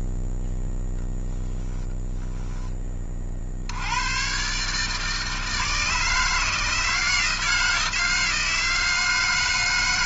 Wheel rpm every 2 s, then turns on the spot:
10, 30, 140, 160, 160.
none